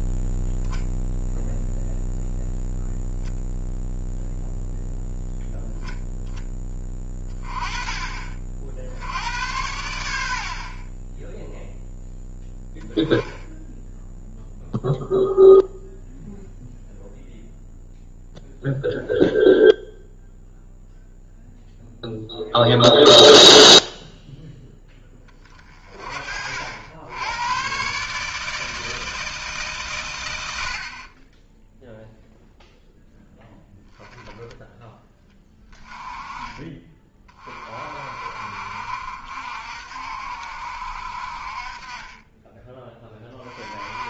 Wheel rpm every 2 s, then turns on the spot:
0, 0, 0, 20, 80, 40, 10, 0, 0, 0, 0, 0, 10, 80, 160, 50, 0, 10, 20, 40, 60, 10.
none